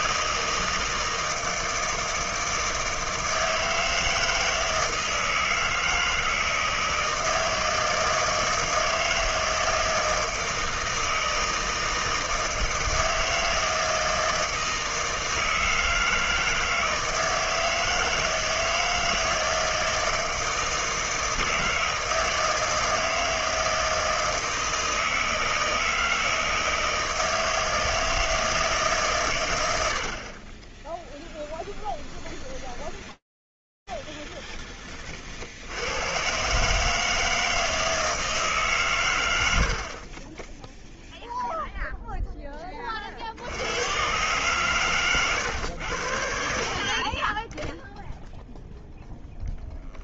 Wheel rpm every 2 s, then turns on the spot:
160, 160, 160, 160, 160, 160, 160, 160, 160, 160, 160, 160, 160, 160, 160, 40, 20, 60, 160, 90, 0, 50, 120, 20, 0.
30-34 38-40